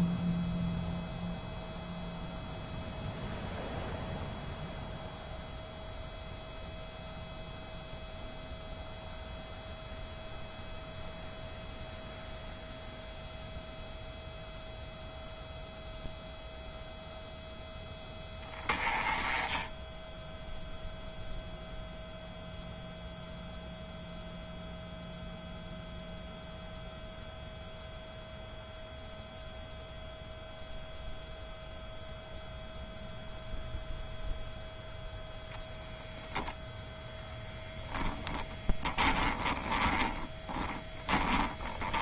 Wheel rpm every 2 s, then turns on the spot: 0, 0, 0, 0, 0, 0, 0, 0, 0, 10, 0, 0, 0, 0, 0, 0, 0, 0, 10, 20, 10.
38-42